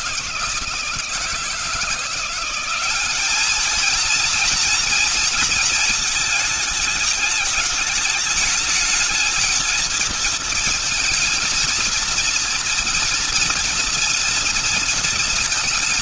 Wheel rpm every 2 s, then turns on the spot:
160, 180, 230, 220, 210, 230, 230, 230.
none